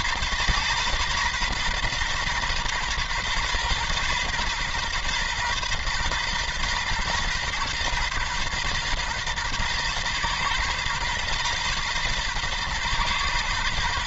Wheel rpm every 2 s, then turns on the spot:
120, 120, 130, 130, 120, 130, 120.
none